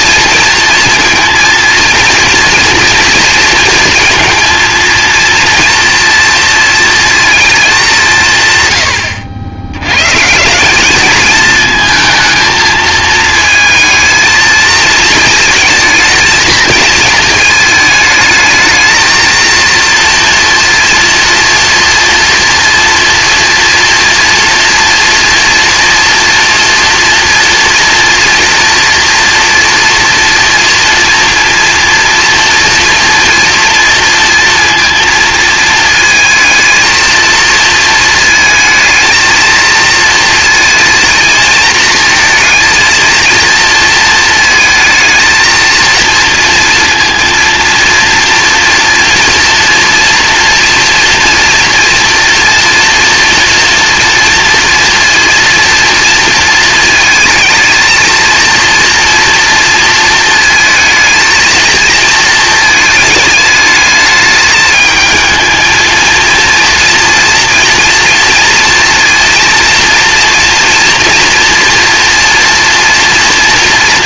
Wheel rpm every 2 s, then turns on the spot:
230, 230, 230, 230, 120, 200, 220, 220, 220, 220, 230, 230, 230, 240, 230, 240, 240, 230, 220, 220, 220, 230, 230, 230, 230, 230, 230, 230, 220, 230, 230, 220, 220, 230, 240, 230, 240.
none